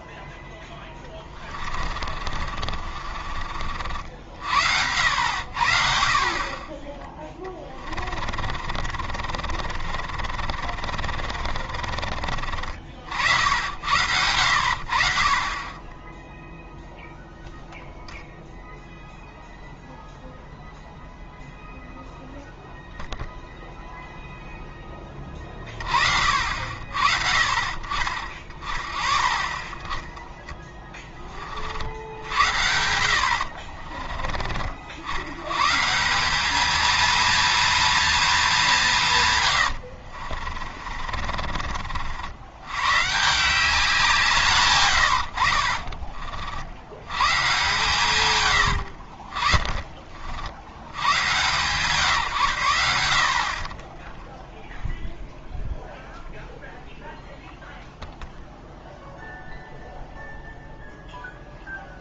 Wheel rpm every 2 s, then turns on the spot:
10, 40, 70, 30, 40, 40, 50, 70, 0, 0, 0, 0, 10, 50, 30, 10, 70, 50, 210, 210, 50, 100, 150, 70, 90, 80, 100, 0, 0, 0, 0.
0-4 8-14 40-42